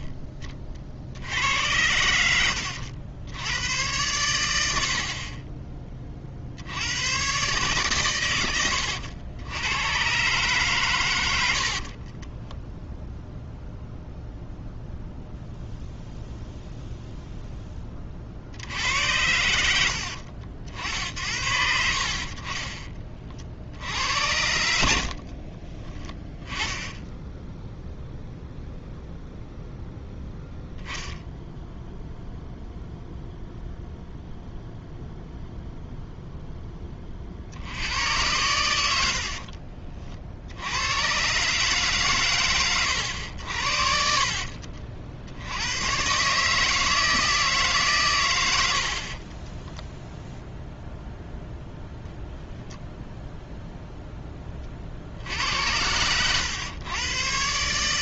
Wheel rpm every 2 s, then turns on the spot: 30, 90, 70, 70, 100, 130, 10, 0, 0, 80, 60, 30, 80, 20, 0, 0, 0, 0, 10, 90, 80, 120, 60, 150, 90, 0, 0, 40, 110.
0-2 44-46